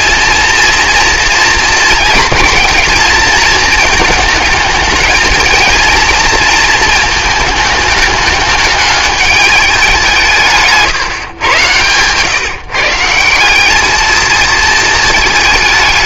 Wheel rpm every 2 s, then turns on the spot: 230, 220, 220, 220, 210, 160, 150, 220.
none